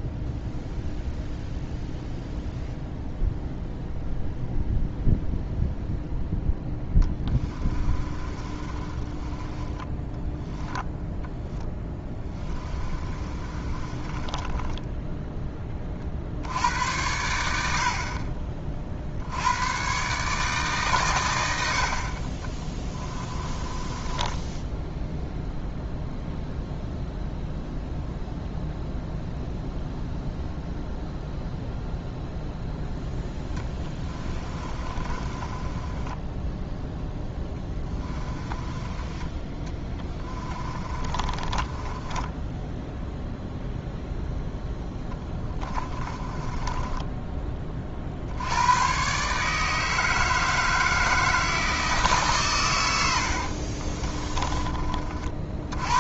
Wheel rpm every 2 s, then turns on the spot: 0, 0, 0, 10, 30, 10, 20, 10, 80, 40, 140, 20, 10, 0, 0, 0, 0, 30, 0, 20, 30, 10, 0, 10, 110, 160, 110, 30.
6-16 22-26 34-36 38-42 46-48